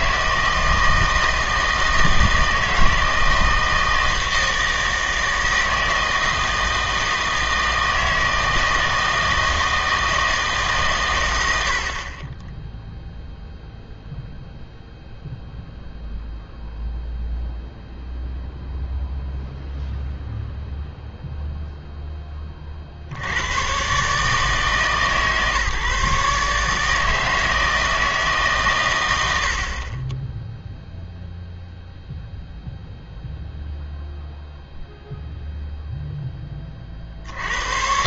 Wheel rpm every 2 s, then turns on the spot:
160, 160, 160, 160, 160, 150, 10, 0, 0, 0, 0, 30, 150, 150, 140, 0, 0, 0, 20.
none